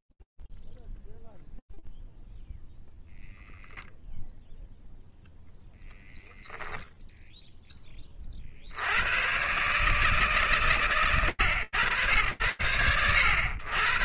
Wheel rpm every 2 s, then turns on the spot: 0, 0, 0, 0, 40, 140, 90.
none